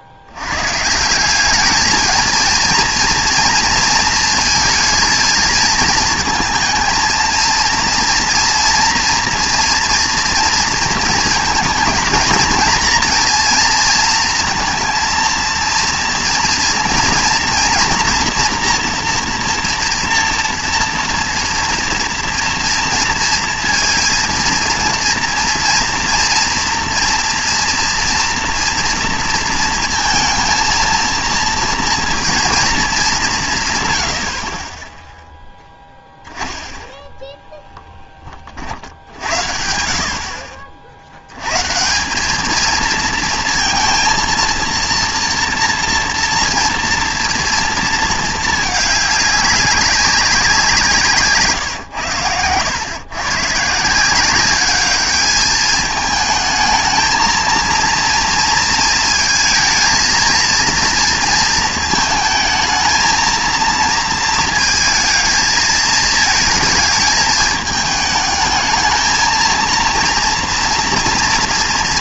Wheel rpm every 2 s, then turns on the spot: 70, 230, 230, 220, 230, 230, 230, 230, 230, 240, 240, 230, 240, 230, 240, 230, 230, 60, 10, 50, 50, 220, 230, 230, 210, 190, 130, 200, 220, 230, 230, 220, 220, 220, 220, 230.
none